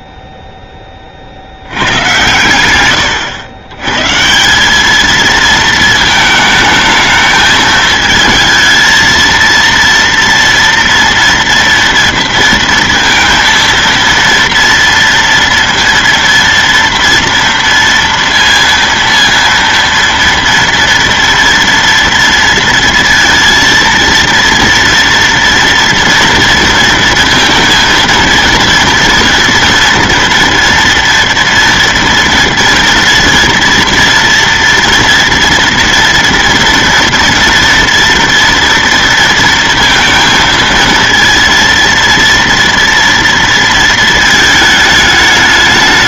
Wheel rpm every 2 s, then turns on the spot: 0, 110, 130, 220, 220, 230, 230, 230, 230, 230, 230, 230, 230, 230, 230, 230, 230, 230, 230, 230, 230, 230, 220.
none